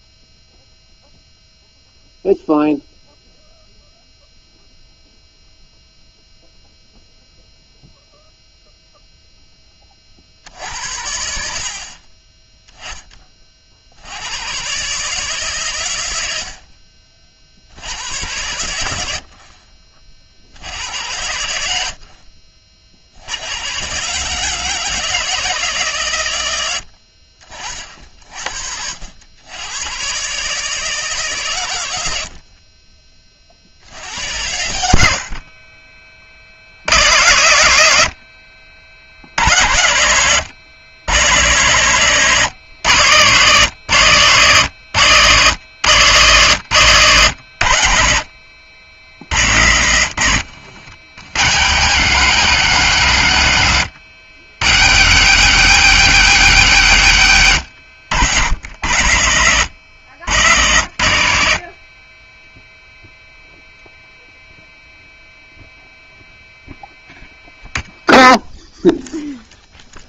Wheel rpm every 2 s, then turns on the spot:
0, 0, 0, 0, 0, 80, 20, 140, 50, 80, 80, 60, 160, 80, 80, 150, 30, 80, 90, 60, 110, 110, 100, 110, 70, 90, 130, 120, 120, 90, 80, 0, 0, 0, 0.
none